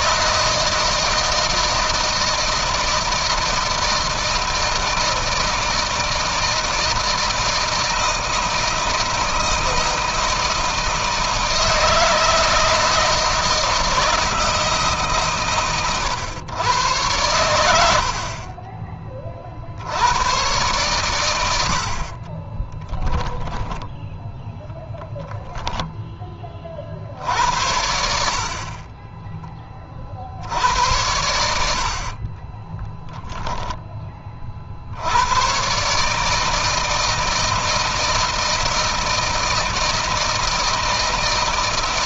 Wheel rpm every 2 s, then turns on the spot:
160, 160, 160, 160, 160, 160, 160, 150, 110, 30, 110, 10, 10, 60, 30, 70, 10, 70, 160, 160, 160.
22-24 28-30 32-34